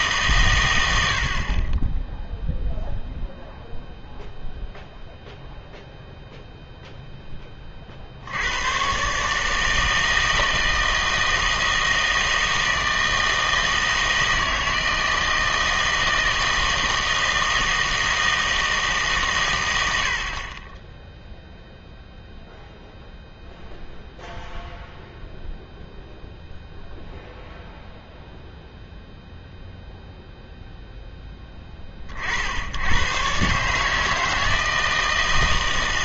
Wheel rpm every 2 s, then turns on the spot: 110, 0, 0, 0, 100, 160, 160, 160, 160, 160, 20, 0, 0, 0, 0, 0, 70, 160.
none